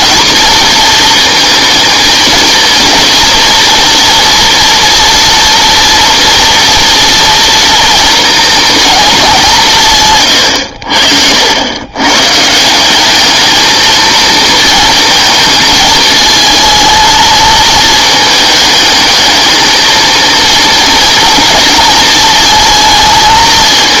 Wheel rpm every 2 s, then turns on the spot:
230, 230, 230, 230, 220, 90, 170, 230, 220, 220, 230, 230.
10-12